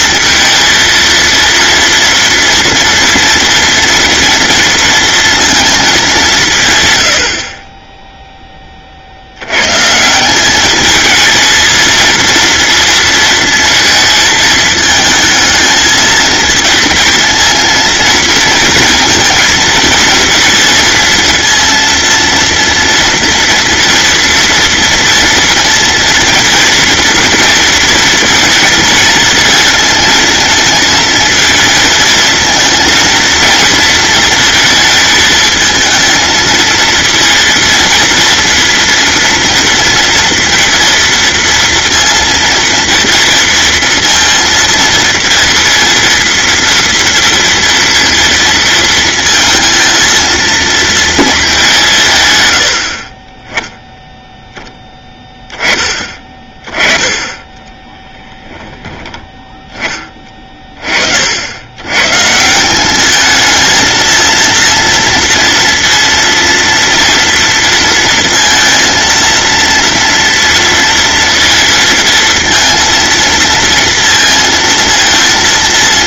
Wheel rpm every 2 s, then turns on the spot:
230, 230, 230, 130, 40, 210, 230, 220, 230, 230, 230, 230, 230, 230, 220, 230, 230, 220, 230, 230, 230, 230, 230, 230, 230, 230, 90, 10, 20, 10, 40, 180, 230, 230, 230, 230, 230, 230.
none